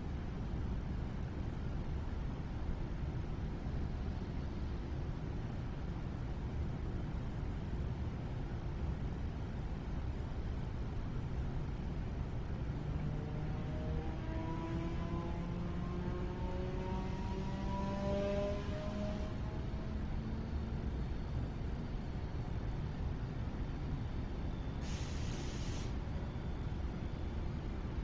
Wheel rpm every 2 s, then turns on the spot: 0, 0, 0, 0, 0, 0, 0, 0, 0, 0, 0, 0, 0, 0.
none